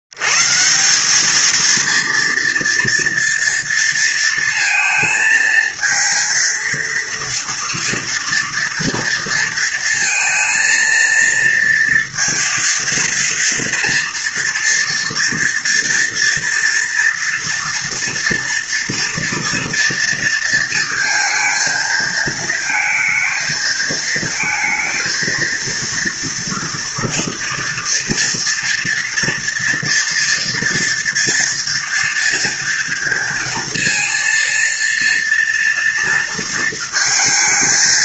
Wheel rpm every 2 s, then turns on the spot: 60, 230, 230, 230, 230, 230, 230, 230, 230, 230, 230, 220, 230, 230, 230, 230, 230, 230, 230.
none